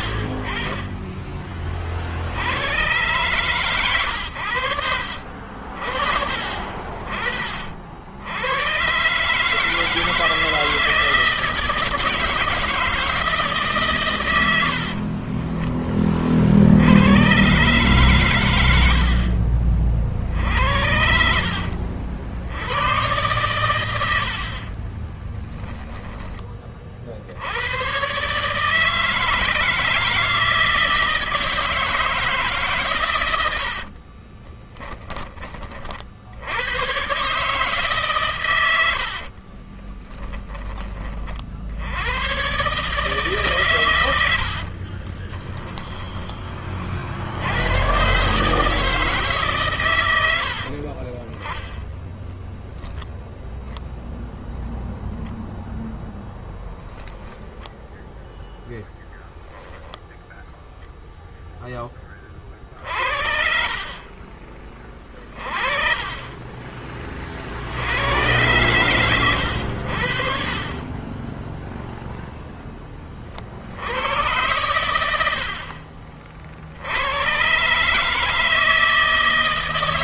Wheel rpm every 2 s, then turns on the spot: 30, 100, 60, 40, 120, 160, 160, 50, 100, 100, 70, 100, 30, 30, 150, 160, 130, 20, 110, 80, 30, 130, 40, 50, 160, 50, 0, 0, 10, 20, 10, 50, 20, 30, 110, 20, 10, 100, 80, 160.
14-16 20-22 24-26 34-36 38-40 44-46 50-52 58-60